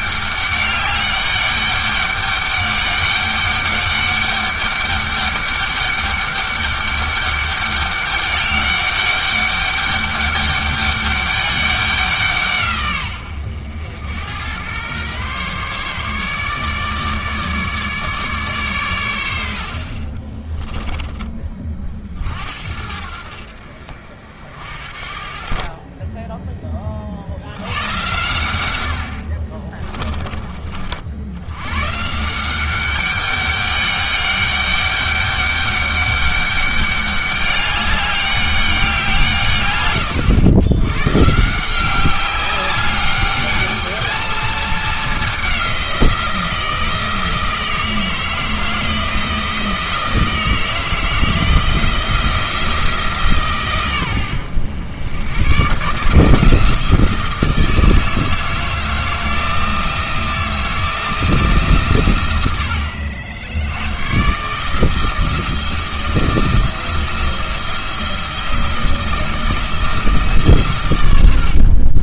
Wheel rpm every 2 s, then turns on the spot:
200, 200, 200, 200, 200, 200, 130, 110, 150, 130, 10, 60, 60, 30, 90, 40, 190, 200, 200, 200, 110, 200, 220, 160, 160, 160, 160, 100, 160, 160, 160, 80, 150, 170, 170, 130.
20-22